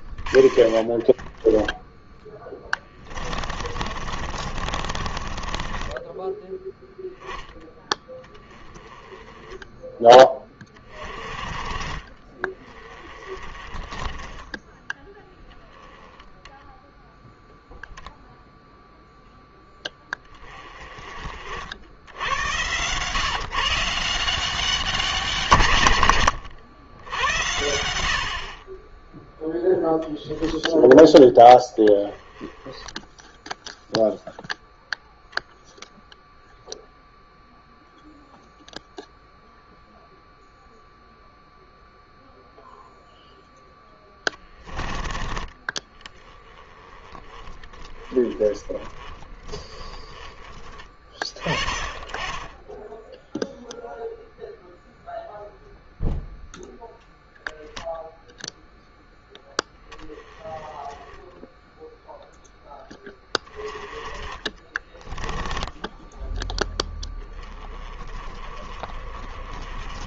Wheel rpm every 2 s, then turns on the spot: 40, 20, 30, 10, 10, 20, 20, 10, 0, 0, 20, 110, 190, 100, 30, 0, 10, 0, 0, 0, 0, 0, 10, 10, 10, 20, 10, 0, 0, 10, 20, 10, 30, 10, 30.
0-6